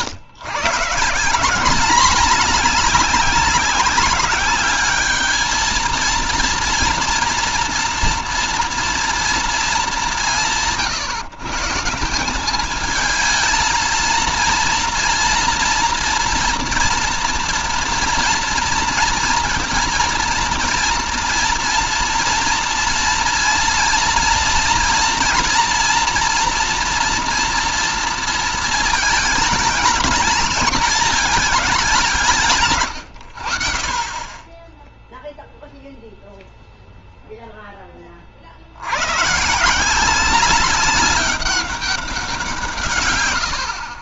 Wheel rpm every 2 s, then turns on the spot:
130, 200, 210, 230, 230, 180, 190, 230, 230, 240, 230, 230, 230, 240, 230, 220, 170, 20, 0, 50, 190, 160.
none